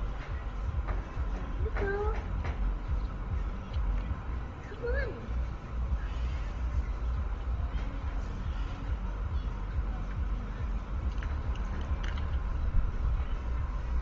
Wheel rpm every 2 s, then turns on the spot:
0, 0, 0, 0, 0, 0, 0.
none